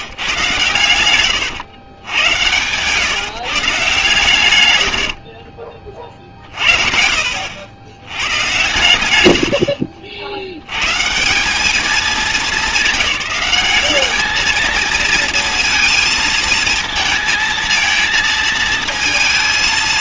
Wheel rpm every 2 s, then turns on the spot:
120, 110, 120, 40, 110, 100, 210, 220, 230, 230.
none